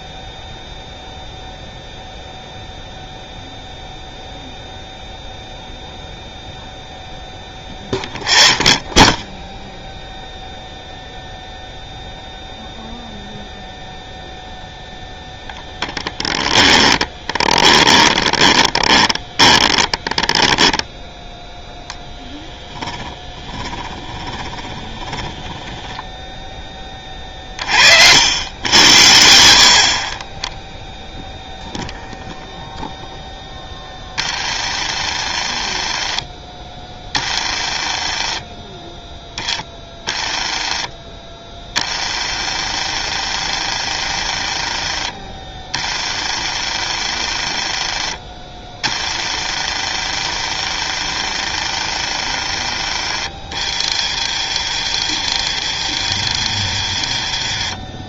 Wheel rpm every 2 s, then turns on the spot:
0, 0, 0, 0, 10, 0, 0, 0, 10, 30, 10, 10, 20, 10, 90, 10, 0, 40, 20, 20, 20, 50, 40, 50, 30, 50, 50, 50, 50.
16-26 34-58